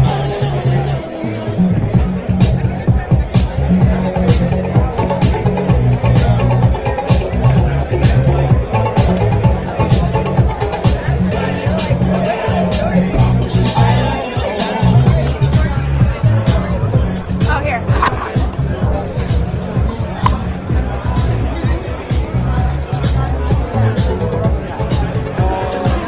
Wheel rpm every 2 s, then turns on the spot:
0, 0, 0, 0, 0, 0, 0, 0, 0, 0, 0, 0, 0.
none